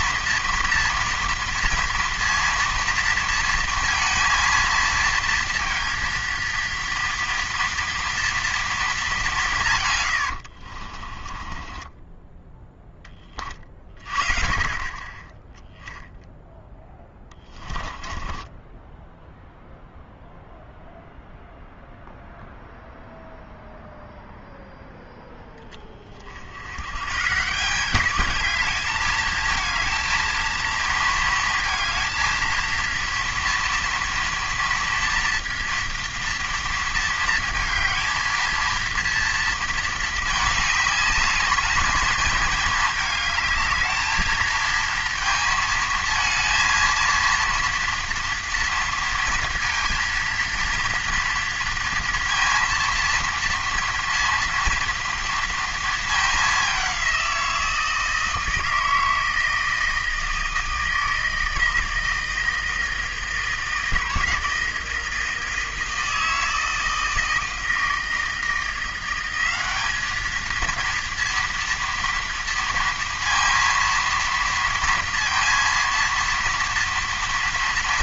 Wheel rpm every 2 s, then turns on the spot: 230, 230, 230, 230, 230, 60, 10, 30, 0, 10, 0, 0, 0, 80, 210, 220, 230, 230, 230, 230, 210, 220, 230, 230, 230, 230, 230, 230, 200, 160, 160, 160, 160, 160, 170, 220, 230, 230, 230.
10-12 18-20